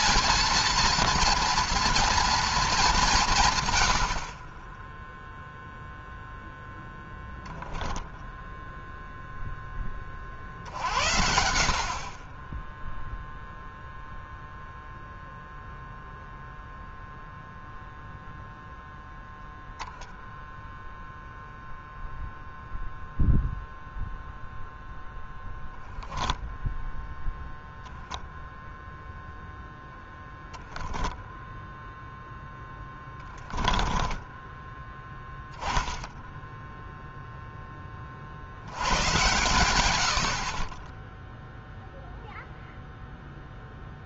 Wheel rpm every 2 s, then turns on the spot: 230, 190, 0, 0, 0, 70, 0, 0, 0, 0, 0, 0, 0, 0, 0, 0, 20, 10, 0, 110, 20, 0.
32-34